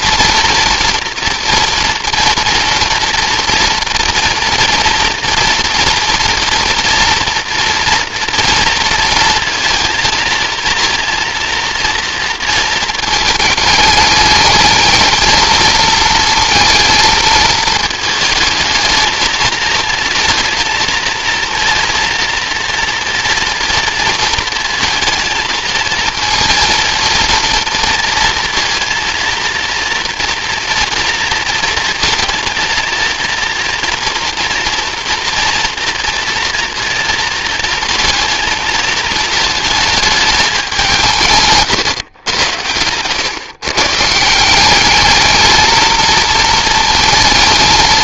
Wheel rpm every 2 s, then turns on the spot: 230, 240, 230, 230, 230, 230, 220, 220, 230, 220, 230, 230, 220, 230, 230, 240, 230, 230, 230, 220, 190, 100, 190, 230.
none